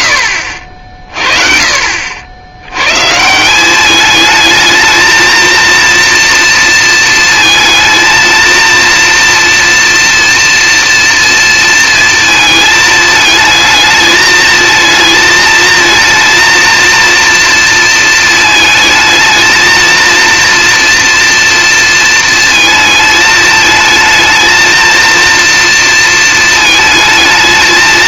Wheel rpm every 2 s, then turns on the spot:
30, 150, 230, 220, 230, 230, 220, 220, 230, 220, 230, 220, 230, 220.
none